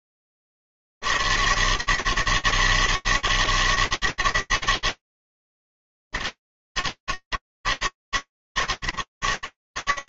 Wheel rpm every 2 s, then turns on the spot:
80, 160, 160, 150, 100.
none